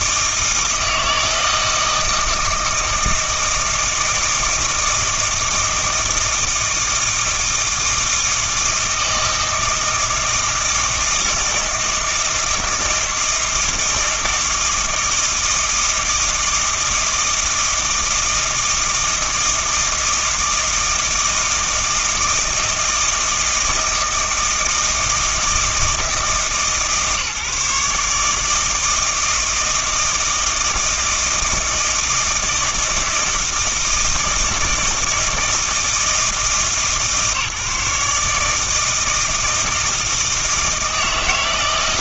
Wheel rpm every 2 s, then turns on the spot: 160, 160, 160, 160, 160, 160, 160, 160, 160, 160, 160, 160, 160, 150, 160, 160, 160, 160, 160, 160, 160.
none